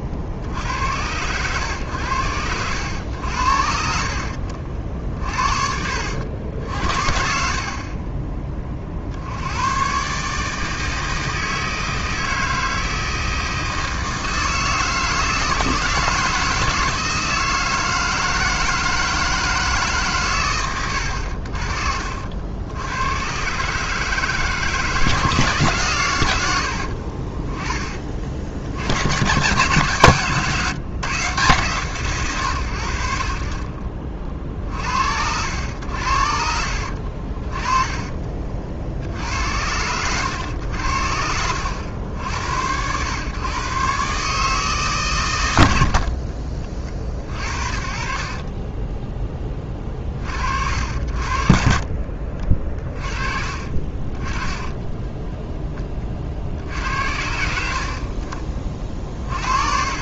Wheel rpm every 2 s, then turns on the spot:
90, 90, 50, 60, 40, 160, 160, 160, 160, 160, 80, 100, 160, 60, 80, 150, 80, 70, 60, 60, 80, 100, 140, 50, 20, 60, 40, 10, 70, 30.
6-8 20-22 26-28 36-38 48-50